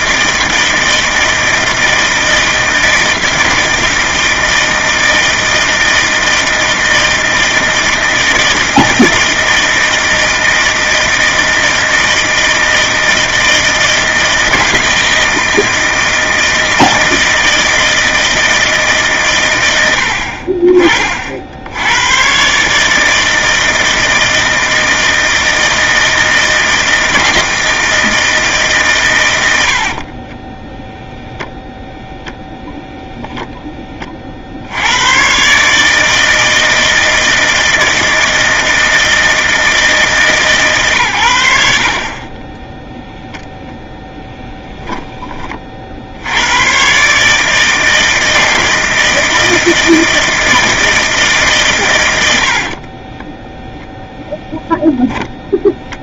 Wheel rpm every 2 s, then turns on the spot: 160, 160, 160, 160, 160, 160, 160, 160, 160, 160, 40, 140, 160, 160, 150, 20, 0, 60, 160, 160, 140, 10, 10, 90, 160, 160, 60, 0.
30-32 52-54